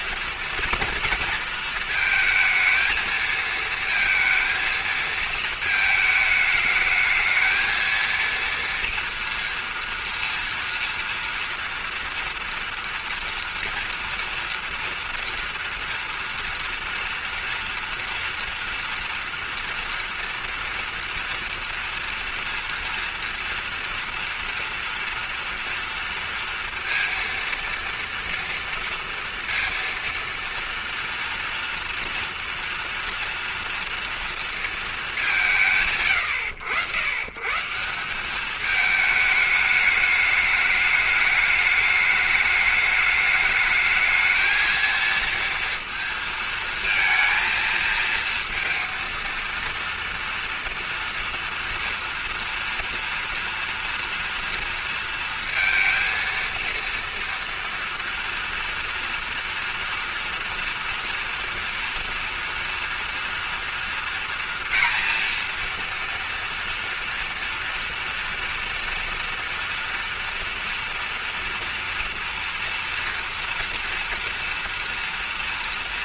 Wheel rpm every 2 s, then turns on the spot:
230, 230, 230, 210, 230, 230, 230, 230, 230, 230, 230, 230, 230, 230, 230, 230, 230, 220, 90, 210, 210, 210, 220, 230, 230, 230, 230, 230, 230, 230, 230, 230, 230, 230, 230, 230, 230, 240.
none